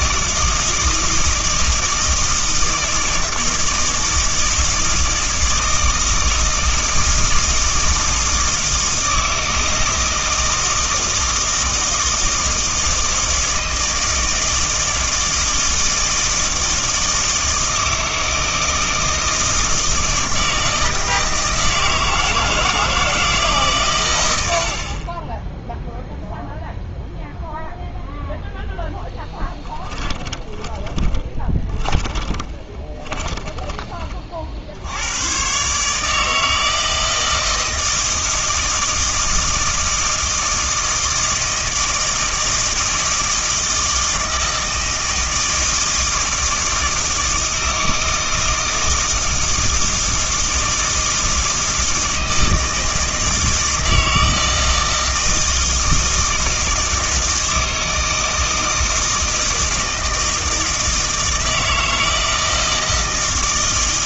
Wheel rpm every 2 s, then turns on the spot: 160, 160, 160, 160, 160, 160, 160, 160, 160, 160, 160, 160, 70, 0, 10, 20, 20, 70, 160, 160, 160, 160, 160, 160, 160, 160, 160, 160, 160, 160, 160, 160.
28-34